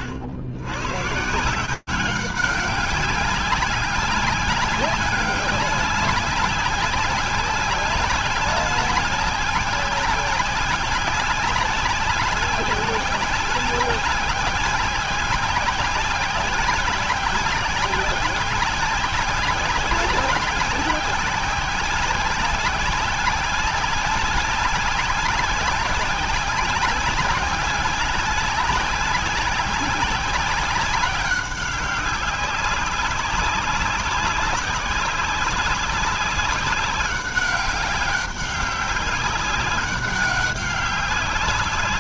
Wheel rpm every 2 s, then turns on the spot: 130, 200, 190, 190, 190, 190, 190, 190, 190, 190, 190, 190, 190, 190, 190, 190, 190, 200, 200, 200, 200.
none